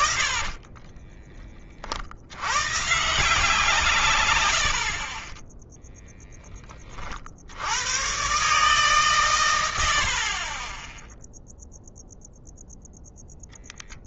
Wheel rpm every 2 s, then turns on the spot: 10, 140, 50, 20, 140, 10, 0.
0-2